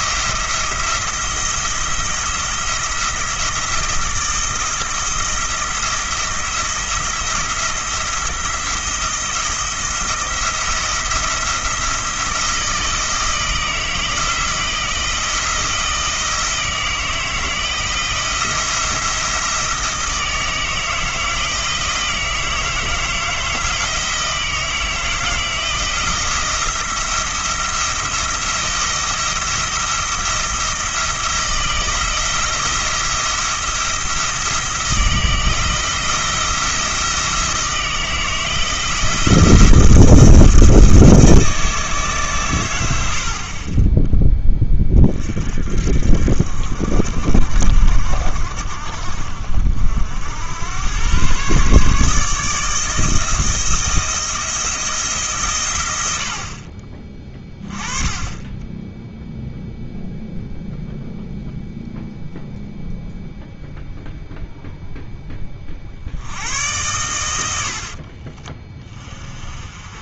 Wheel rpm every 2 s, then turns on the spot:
170, 170, 170, 170, 170, 170, 160, 170, 160, 170, 160, 160, 160, 170, 170, 170, 170, 170, 170, 160, 160, 90, 30, 70, 50, 110, 160, 160, 30, 10, 0, 0, 0, 110, 30.
none